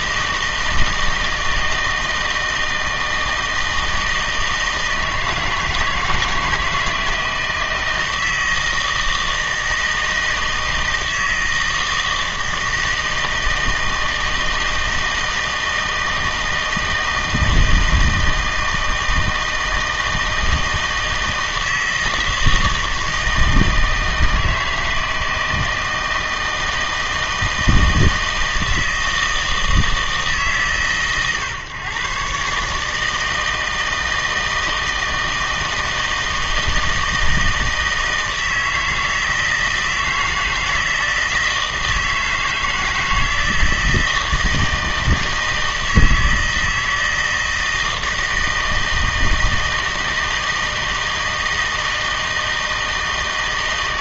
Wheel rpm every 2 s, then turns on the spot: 160, 160, 160, 160, 160, 160, 160, 160, 160, 160, 160, 160, 160, 160, 160, 130, 150, 160, 160, 160, 160, 160, 160, 160, 160, 160, 160.
none